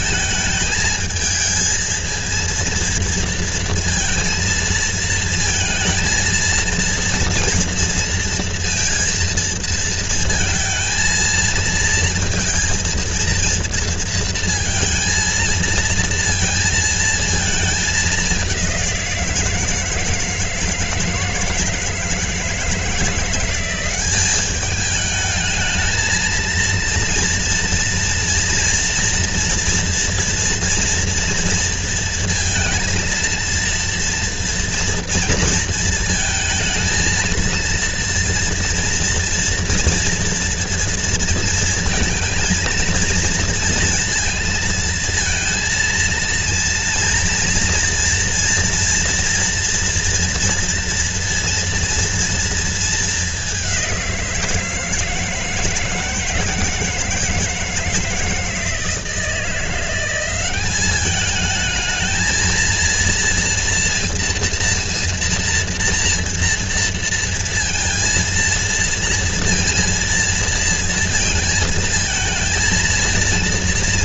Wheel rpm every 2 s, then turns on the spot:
220, 230, 230, 230, 230, 230, 230, 230, 230, 180, 160, 160, 210, 230, 230, 230, 230, 240, 230, 230, 230, 230, 230, 230, 230, 230, 220, 160, 160, 160, 200, 230, 230, 230, 230, 230, 230.
none